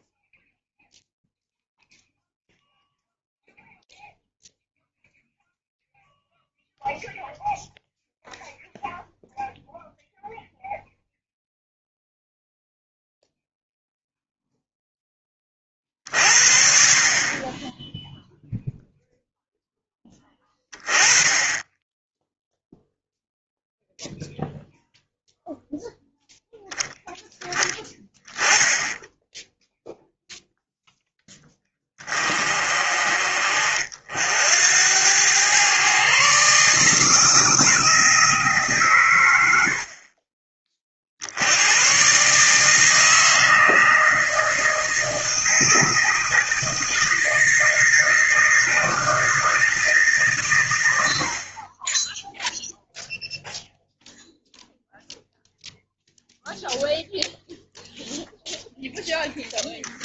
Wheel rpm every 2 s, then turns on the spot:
0, 0, 0, 0, 0, 0, 0, 0, 40, 0, 20, 0, 0, 0, 0, 0, 40, 90, 150, 140, 40, 150, 160, 160, 160, 100, 0, 0, 0, 0.
none